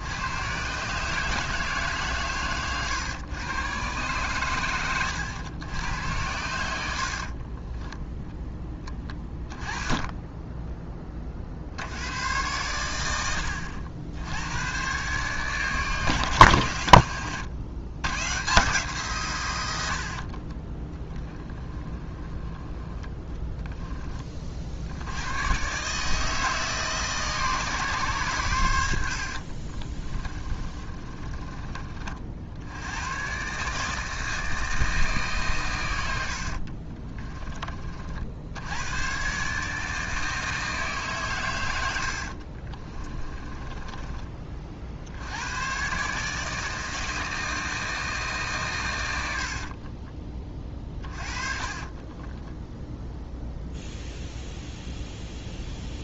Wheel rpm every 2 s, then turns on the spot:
130, 120, 100, 80, 10, 20, 100, 110, 100, 150, 30, 20, 70, 150, 90, 30, 90, 160, 30, 100, 150, 30, 60, 160, 120, 40, 0, 0.
6-8 30-32 36-38 42-44 50-52